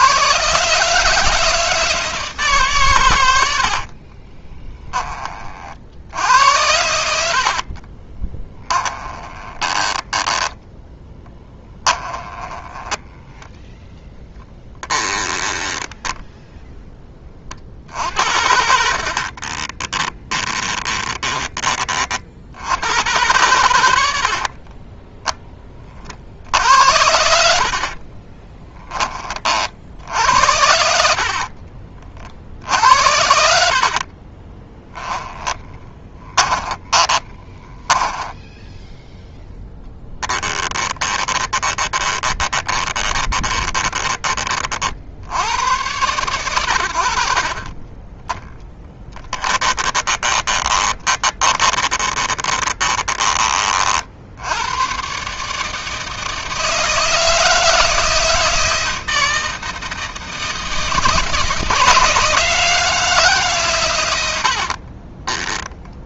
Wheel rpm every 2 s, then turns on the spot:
140, 140, 10, 80, 20, 10, 10, 10, 10, 60, 20, 90, 30, 70, 10, 70, 60, 10, 20, 10, 10, 20, 40, 100, 10, 20, 20, 100, 160, 160, 160, 160, 50.
8-16 18-22 24-26 28-32 34-38 40-44 48-54 64-66